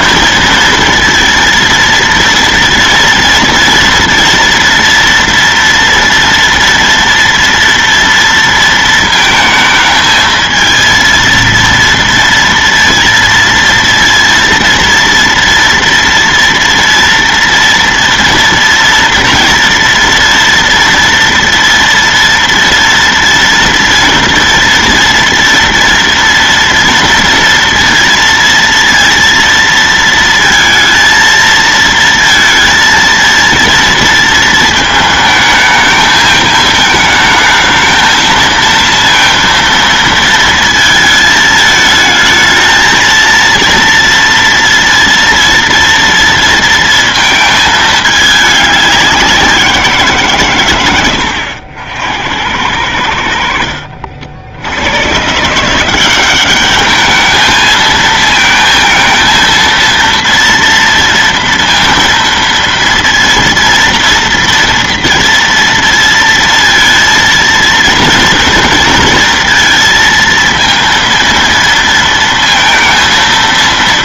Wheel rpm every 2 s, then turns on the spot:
230, 230, 230, 230, 230, 230, 230, 230, 230, 230, 230, 230, 230, 230, 230, 230, 230, 220, 220, 230, 220, 220, 230, 230, 200, 110, 90, 80, 200, 220, 230, 230, 230, 230, 230, 230, 230.
none